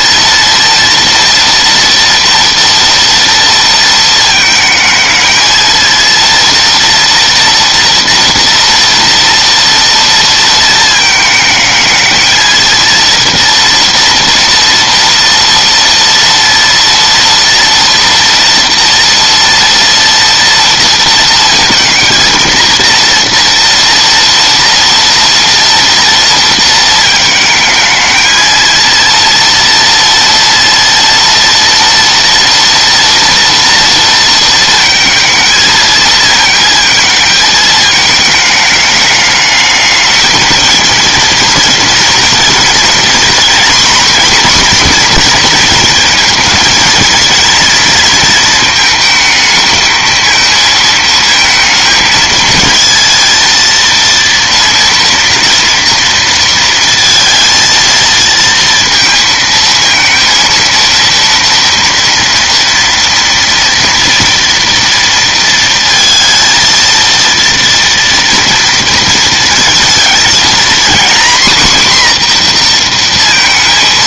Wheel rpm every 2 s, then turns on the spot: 230, 230, 220, 230, 230, 220, 230, 230, 230, 230, 230, 230, 230, 230, 230, 230, 230, 230, 220, 210, 220, 230, 240, 230, 220, 220, 220, 230, 230, 230, 230, 230, 230, 230, 230, 230, 240.
none